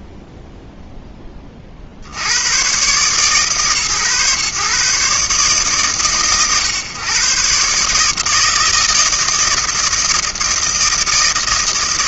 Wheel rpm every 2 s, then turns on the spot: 40, 140, 130, 130, 160, 160.
none